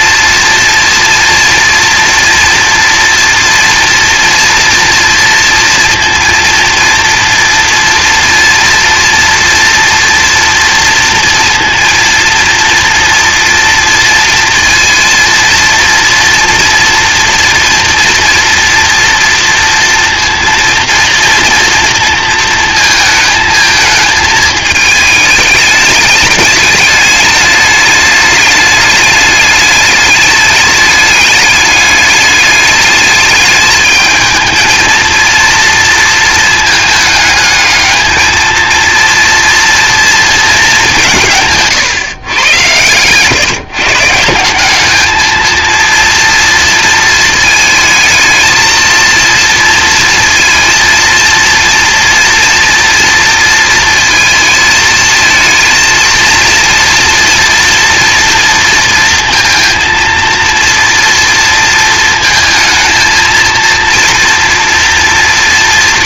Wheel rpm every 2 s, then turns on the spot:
230, 240, 230, 230, 230, 240, 230, 230, 240, 230, 230, 230, 220, 210, 210, 210, 210, 220, 220, 230, 210, 110, 190, 230, 230, 230, 230, 220, 230, 230, 230, 220, 230.
none